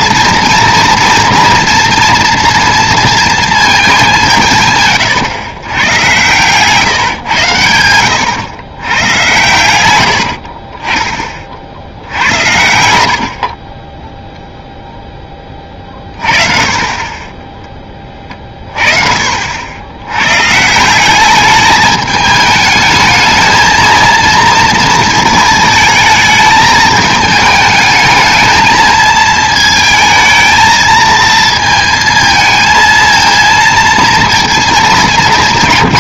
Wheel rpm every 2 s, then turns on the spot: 230, 230, 140, 130, 110, 40, 80, 0, 20, 30, 150, 220, 230, 220, 220, 220, 220, 220.
10-12